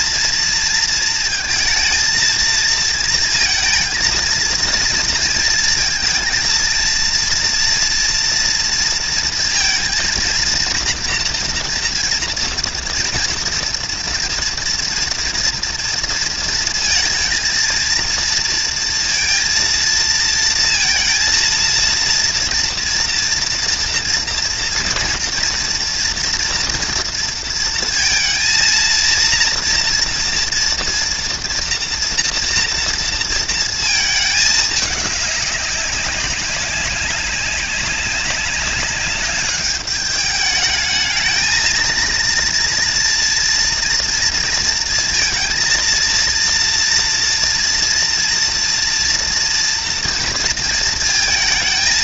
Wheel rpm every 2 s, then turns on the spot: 230, 230, 230, 230, 230, 230, 240, 230, 220, 230, 230, 240, 240, 230, 230, 230, 230, 210, 190, 200, 220, 230, 230, 230, 230, 230.
none